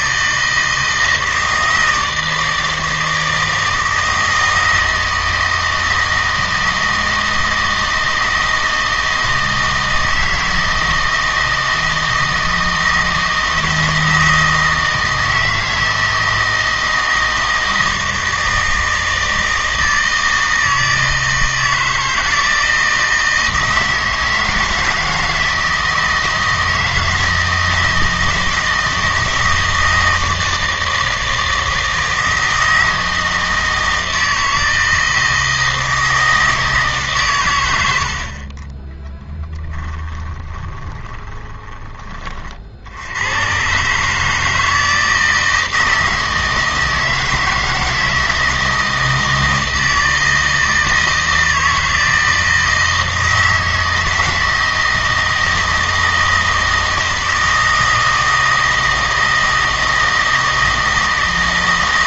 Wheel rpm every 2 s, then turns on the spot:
160, 160, 160, 160, 160, 160, 160, 160, 160, 160, 160, 160, 160, 160, 160, 160, 160, 160, 160, 30, 10, 50, 160, 160, 160, 160, 160, 160, 160, 160, 160.
40-42